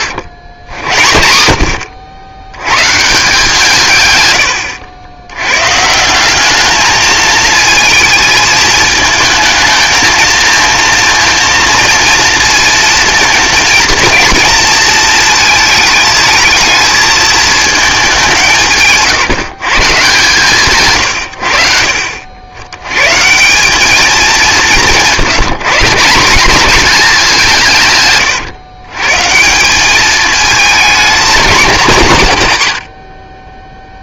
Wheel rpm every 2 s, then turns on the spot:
70, 150, 80, 210, 220, 230, 230, 230, 220, 160, 110, 110, 160, 210, 140, 220, 90.
none